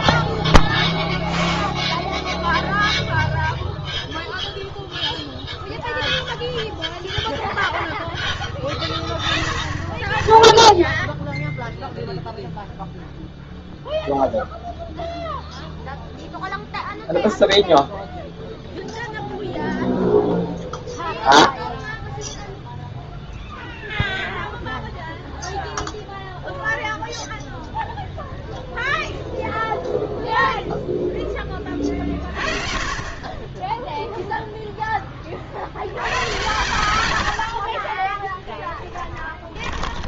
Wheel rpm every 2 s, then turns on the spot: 0, 0, 0, 0, 20, 0, 0, 0, 0, 0, 0, 0, 0, 0, 0, 0, 40, 0, 110, 10.
36-40